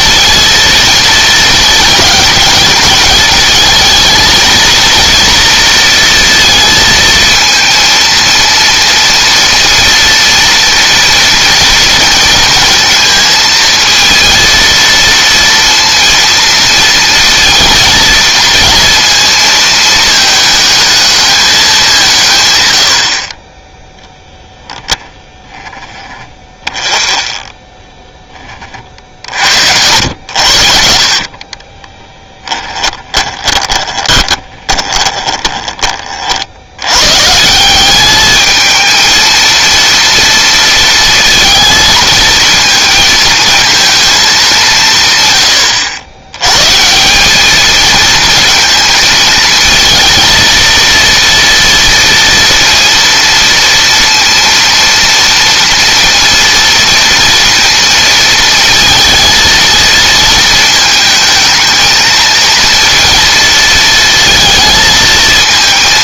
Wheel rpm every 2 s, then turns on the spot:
230, 210, 230, 220, 230, 230, 230, 230, 230, 230, 210, 90, 10, 20, 40, 50, 20, 20, 110, 220, 230, 220, 150, 160, 230, 230, 230, 230, 230, 220, 220, 230, 220.
26-36